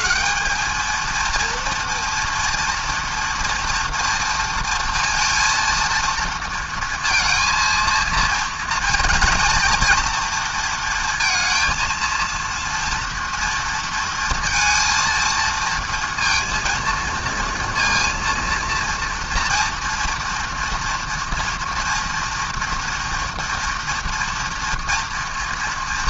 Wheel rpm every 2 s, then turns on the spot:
220, 230, 230, 230, 230, 230, 230, 230, 230, 230, 240, 240, 230.
none